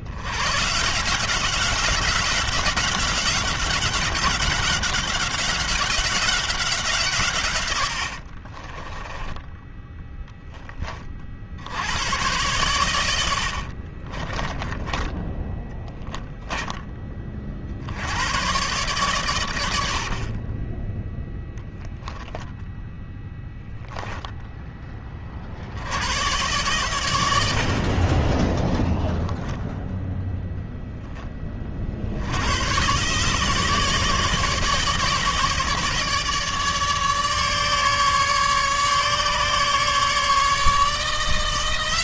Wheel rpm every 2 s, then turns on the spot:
60, 190, 190, 180, 70, 20, 90, 40, 10, 80, 80, 0, 0, 90, 40, 0, 50, 150, 150, 150, 150.
8-12 14-16 20-22